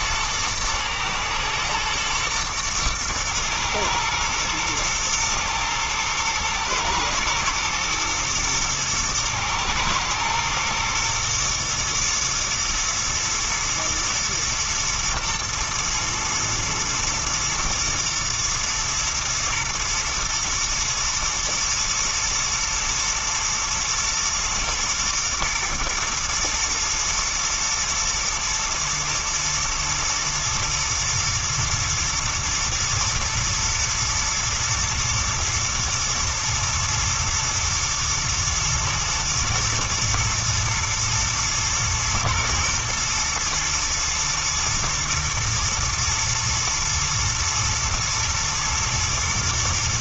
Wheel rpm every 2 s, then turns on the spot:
110, 110, 120, 110, 110, 120, 120, 120, 120, 120, 120, 120, 110, 120, 120, 120, 110, 120, 110, 110, 110, 120, 120, 120, 120.
none